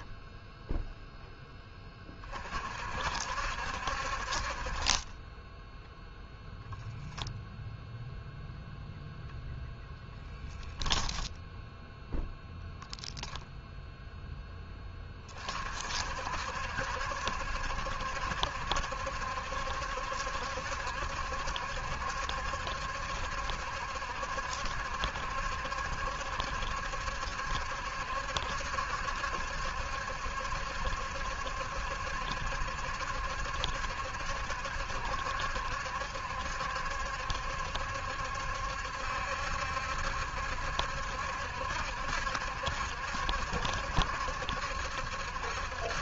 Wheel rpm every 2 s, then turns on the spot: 10, 60, 10, 0, 0, 0, 0, 30, 70, 70, 70, 70, 70, 70, 70, 70, 70, 70, 70, 70, 70, 70, 70.
none